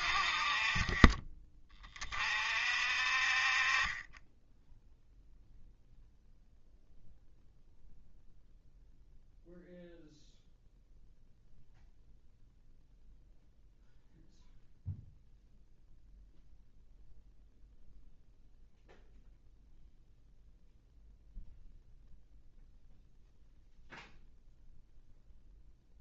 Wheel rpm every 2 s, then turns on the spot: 40, 50, 10, 0, 0, 0, 0, 0, 0, 0, 0, 0, 0.
none